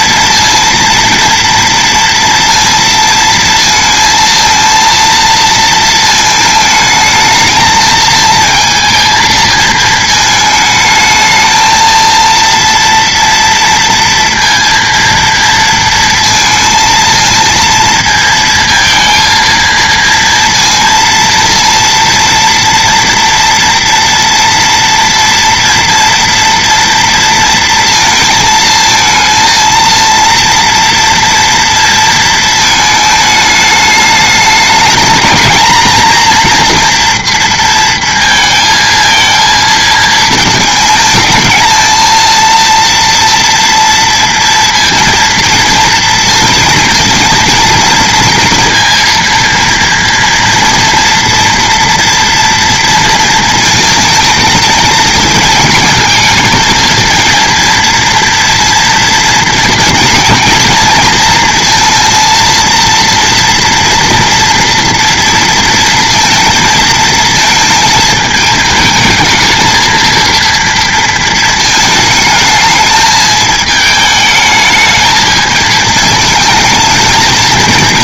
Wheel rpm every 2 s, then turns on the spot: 230, 230, 230, 220, 220, 220, 230, 230, 230, 230, 230, 230, 230, 230, 230, 230, 220, 220, 240, 230, 230, 230, 230, 230, 230, 230, 230, 220, 220, 230, 230, 230, 230, 230, 220, 230, 220, 220, 220.
none